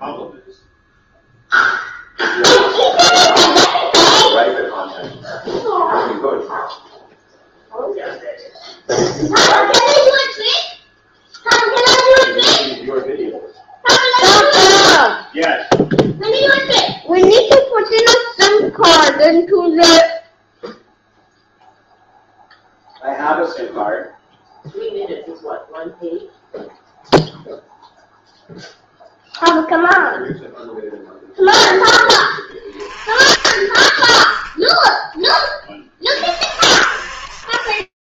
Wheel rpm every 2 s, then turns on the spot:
0, 0, 0, 0, 0, 0, 0, 0, 0, 0, 0, 0, 0, 0, 0, 0, 30, 10, 50.
none